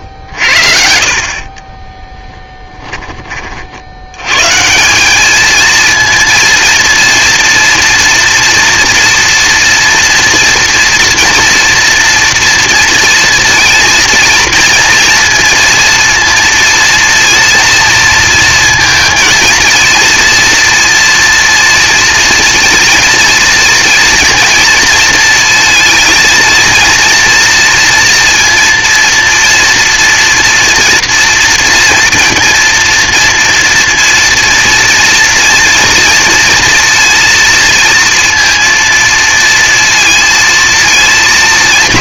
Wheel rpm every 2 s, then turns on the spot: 70, 20, 150, 230, 230, 230, 230, 230, 230, 230, 230, 230, 230, 230, 230, 230, 240, 230, 230, 230, 220.
2-4